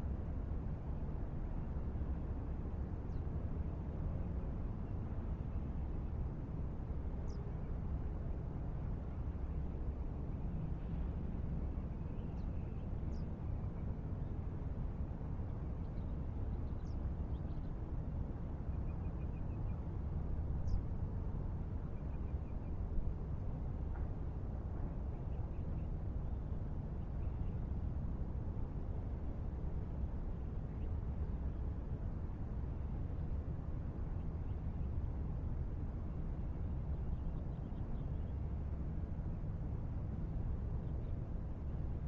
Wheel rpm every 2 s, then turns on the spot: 0, 0, 0, 0, 0, 0, 0, 0, 0, 0, 0, 0, 0, 0, 0, 0, 0, 0, 0, 0, 0.
none